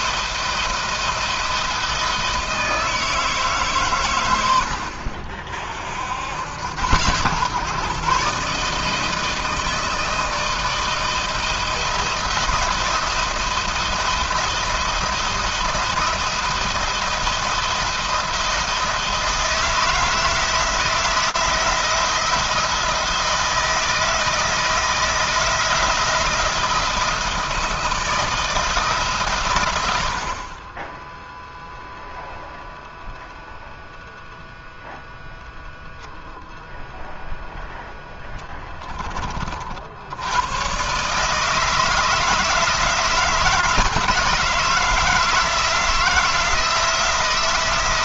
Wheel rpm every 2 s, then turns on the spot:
170, 160, 60, 100, 150, 170, 170, 170, 170, 160, 160, 170, 160, 170, 150, 20, 0, 0, 0, 20, 130, 170, 160, 160.
none